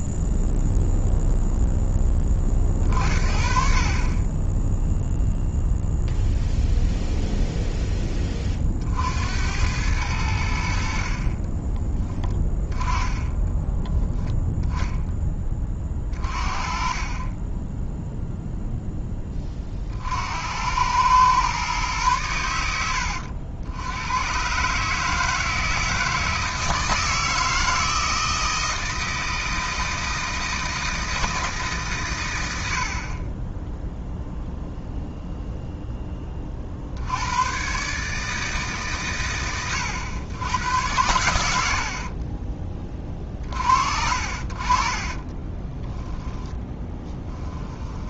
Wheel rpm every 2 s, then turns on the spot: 0, 40, 10, 0, 40, 60, 10, 10, 30, 0, 90, 90, 140, 160, 160, 160, 80, 0, 50, 140, 100, 30, 40, 10.
46-48